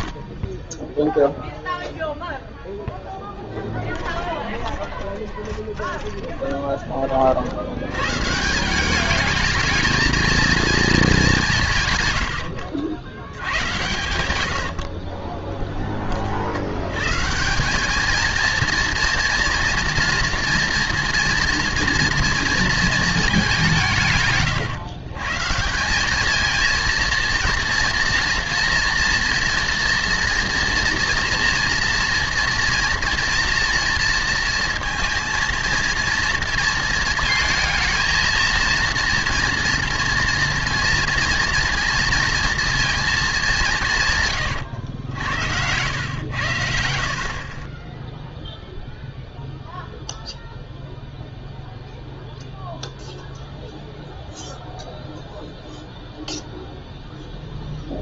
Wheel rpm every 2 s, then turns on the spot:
0, 0, 20, 20, 180, 230, 90, 70, 110, 230, 230, 230, 130, 230, 230, 230, 230, 230, 230, 230, 230, 230, 110, 60, 0, 0, 0, 0, 0.
4-6 14-16 44-46